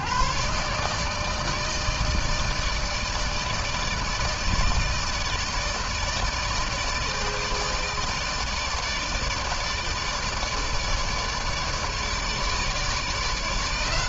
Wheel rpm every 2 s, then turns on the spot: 120, 160, 160, 160, 150, 160, 150.
none